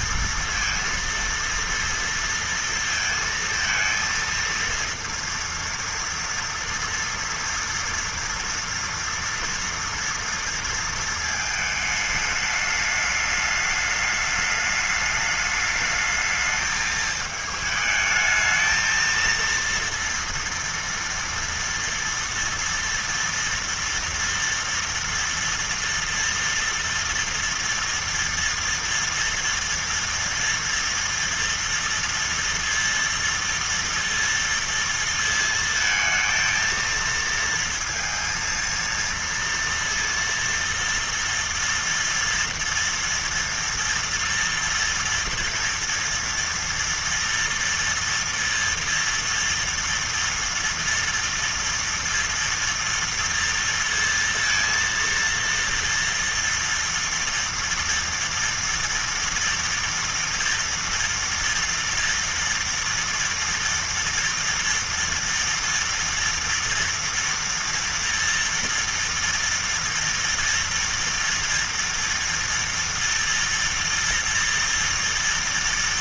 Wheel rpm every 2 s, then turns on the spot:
230, 230, 230, 230, 230, 230, 210, 210, 220, 220, 230, 230, 230, 230, 230, 230, 230, 230, 230, 230, 230, 240, 230, 230, 230, 230, 230, 230, 240, 230, 230, 230, 230, 230, 230, 230, 230, 230.
none